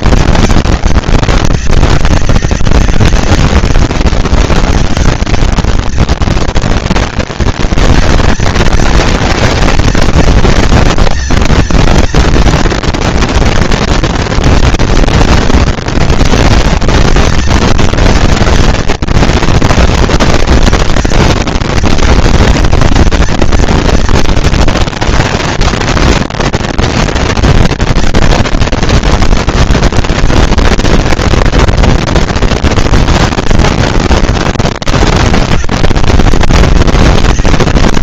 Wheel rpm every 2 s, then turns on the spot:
210, 200, 200, 230, 230, 230, 230, 230, 220, 230, 240, 230, 220, 230, 230, 230, 230, 200, 200.
none